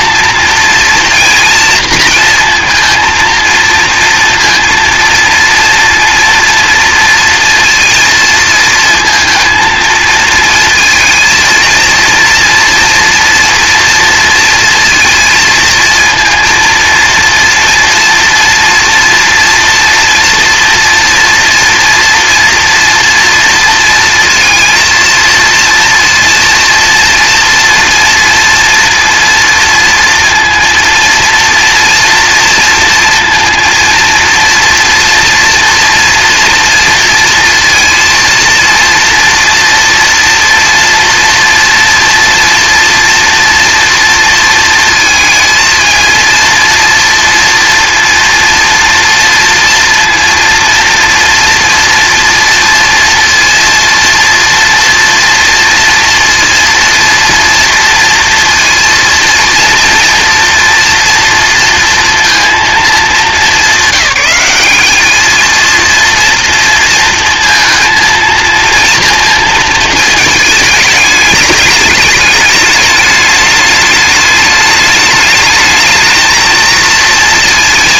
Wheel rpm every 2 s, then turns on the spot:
230, 230, 230, 230, 220, 230, 240, 230, 230, 230, 230, 230, 230, 230, 230, 230, 230, 240, 240, 230, 230, 230, 230, 240, 230, 230, 230, 230, 230, 230, 230, 230, 200, 230, 230, 210, 210, 210, 230.
none